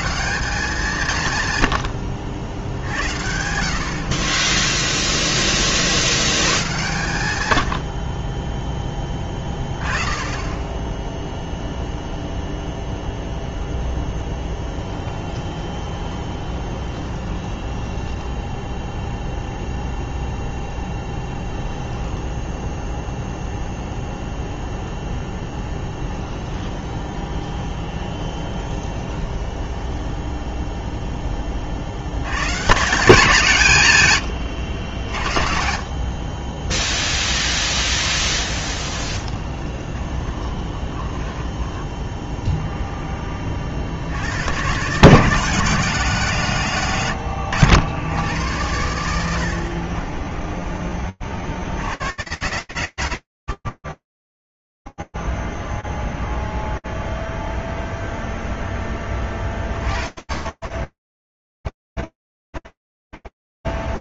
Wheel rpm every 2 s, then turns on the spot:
140, 60, 20, 100, 20, 0, 0, 20, 20, 0, 0, 0, 0, 20, 20, 10, 170, 50, 0, 10, 10, 20, 160, 90, 70, 50, 60, 0, 0, 20, 10, 0.
14-18 26-30 38-42